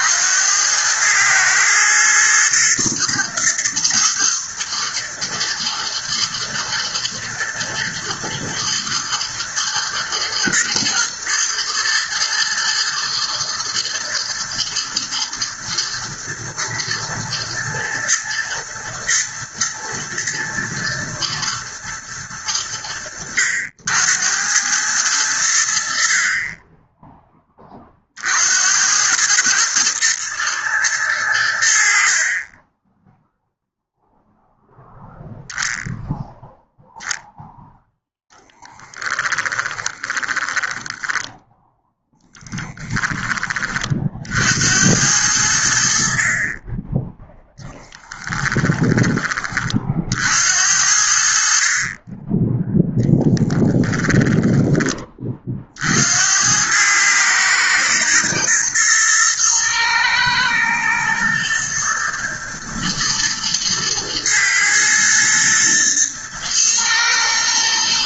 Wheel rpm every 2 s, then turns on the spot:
100, 110, 110, 110, 110, 110, 110, 110, 110, 120, 110, 90, 100, 20, 90, 110, 10, 0, 0, 10, 10, 10, 80, 20, 10, 70, 0, 20, 100, 120, 110, 110, 110, 120.
38-42